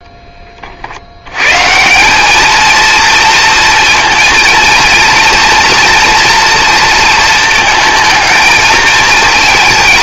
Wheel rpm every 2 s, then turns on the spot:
30, 220, 230, 240, 220.
none